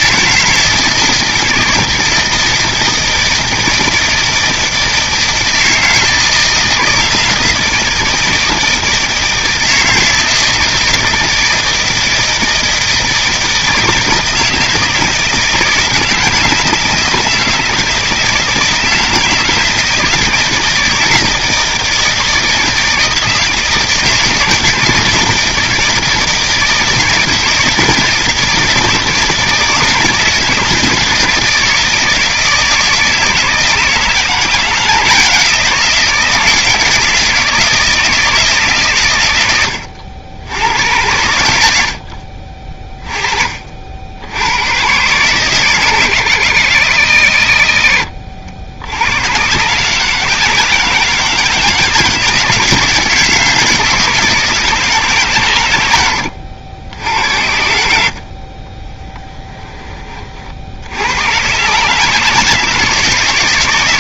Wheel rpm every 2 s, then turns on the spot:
160, 160, 160, 160, 160, 160, 160, 160, 160, 160, 160, 160, 170, 160, 160, 160, 160, 170, 160, 130, 90, 30, 110, 80, 80, 160, 160, 150, 80, 20, 70, 160.
58-60